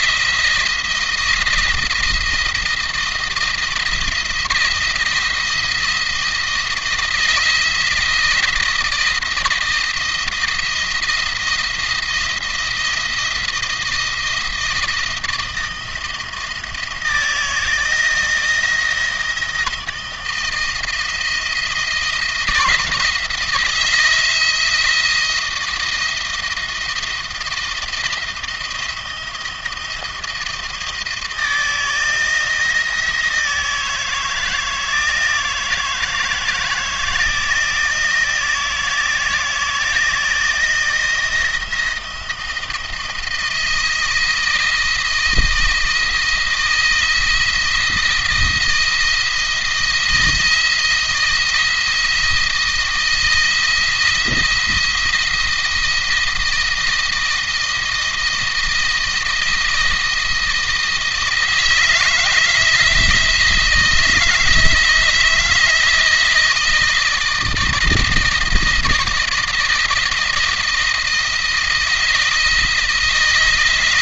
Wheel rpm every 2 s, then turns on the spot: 170, 160, 170, 160, 170, 160, 170, 170, 160, 160, 160, 160, 170, 170, 170, 160, 160, 160, 160, 170, 170, 160, 170, 170, 170, 160, 170, 170, 160, 160, 160, 160, 160, 160, 160, 160, 170.
none